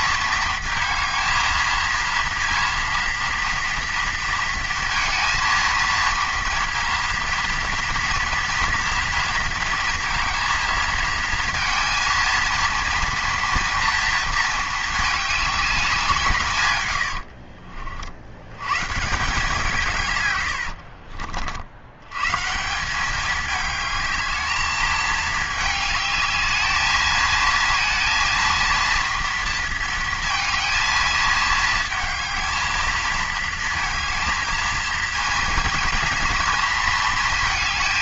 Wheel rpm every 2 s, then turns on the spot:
220, 230, 230, 230, 230, 230, 230, 220, 140, 100, 80, 170, 220, 210, 230, 220, 220, 230, 230.
20-22